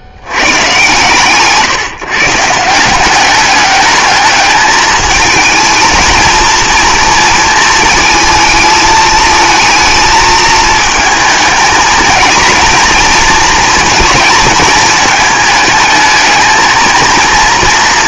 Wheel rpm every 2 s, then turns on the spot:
120, 160, 210, 230, 220, 220, 230, 220, 230.
none